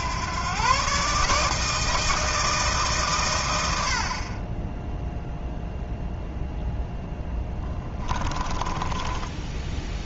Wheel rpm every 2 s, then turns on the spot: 130, 150, 0, 0, 20.
8-10